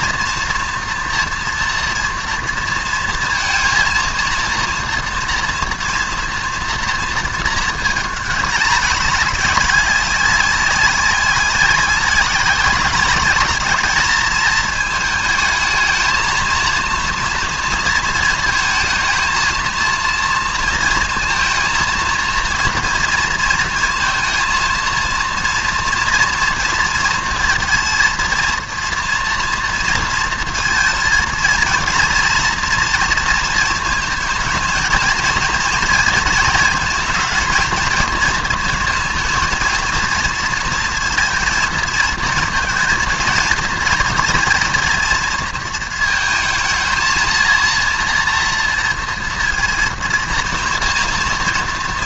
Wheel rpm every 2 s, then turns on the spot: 240, 230, 230, 230, 210, 190, 190, 220, 230, 220, 230, 230, 230, 230, 240, 230, 230, 220, 220, 230, 230, 220, 230, 230, 230, 230.
none